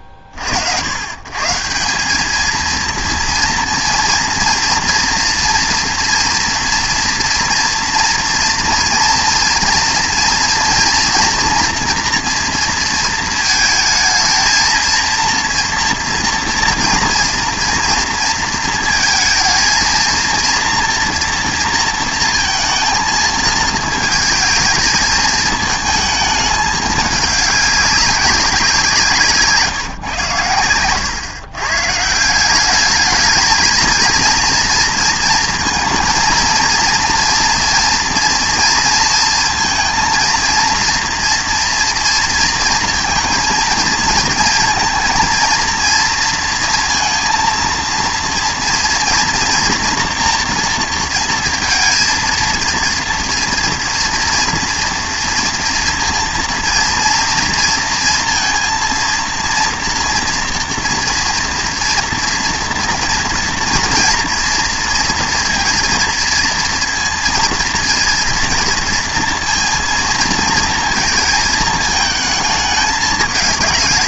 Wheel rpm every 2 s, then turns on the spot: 70, 230, 230, 230, 230, 230, 230, 230, 230, 230, 230, 220, 220, 210, 190, 110, 180, 230, 230, 230, 230, 230, 220, 230, 230, 230, 230, 230, 230, 230, 230, 230, 230, 230, 230, 220, 210.
none